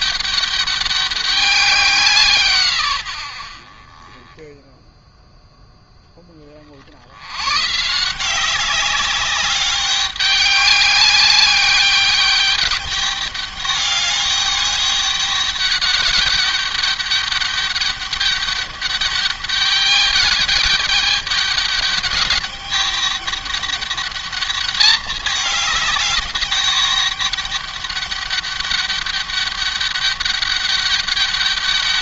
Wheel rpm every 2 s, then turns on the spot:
200, 120, 10, 50, 190, 200, 200, 200, 200, 200, 200, 200, 210, 200, 200, 200.
none